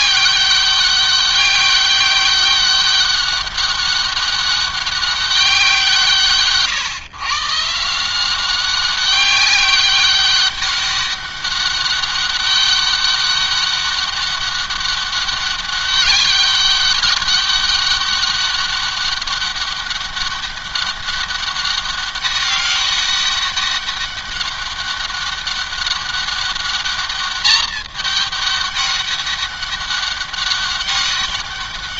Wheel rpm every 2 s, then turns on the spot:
200, 200, 200, 150, 190, 200, 200, 200, 200, 200, 200, 200, 200, 200, 200, 200.
none